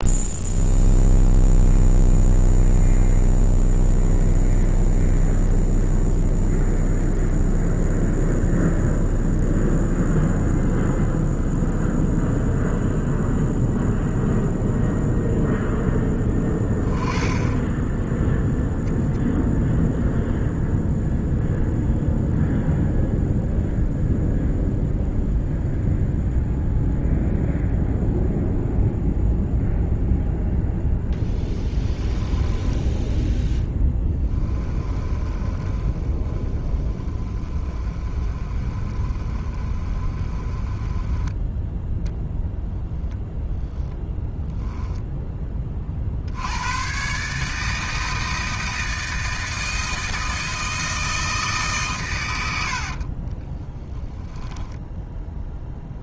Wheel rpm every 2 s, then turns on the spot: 0, 0, 0, 0, 0, 0, 0, 0, 10, 0, 0, 0, 0, 0, 0, 0, 10, 20, 20, 30, 20, 0, 0, 110, 160, 160, 80, 10.
32-42 52-54